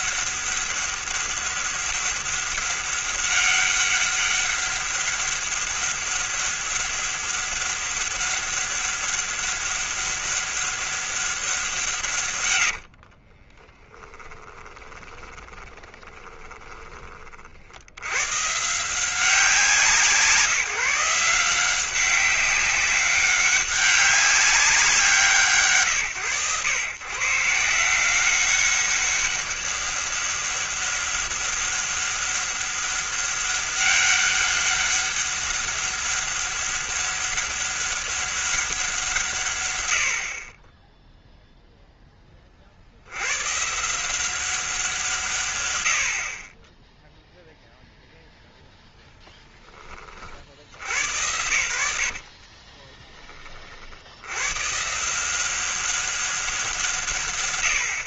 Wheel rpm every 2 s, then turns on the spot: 200, 200, 200, 200, 200, 200, 90, 20, 30, 150, 160, 200, 190, 130, 190, 200, 200, 200, 200, 180, 10, 70, 170, 20, 0, 70, 20, 150, 150.
12-18 52-54